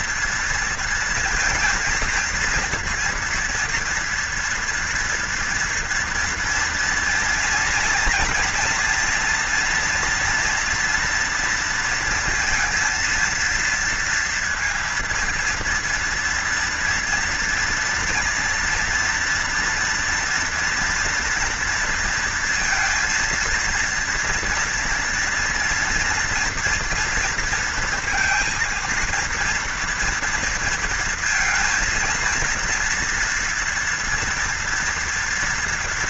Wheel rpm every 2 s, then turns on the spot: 230, 230, 230, 230, 230, 240, 230, 230, 230, 230, 230, 230, 240, 230, 230, 230, 230, 230.
none